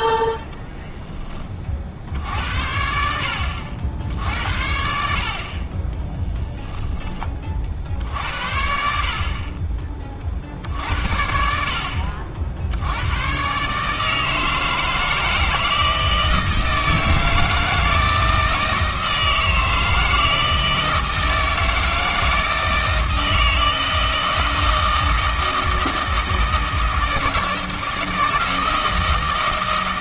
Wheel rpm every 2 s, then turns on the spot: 10, 70, 70, 10, 50, 60, 80, 160, 160, 160, 160, 160, 160, 160, 160.
6-8